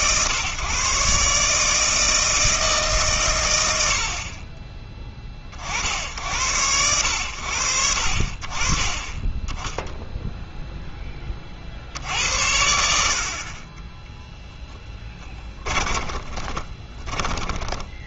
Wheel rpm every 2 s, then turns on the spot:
130, 150, 20, 90, 30, 0, 70, 10, 20.
14-18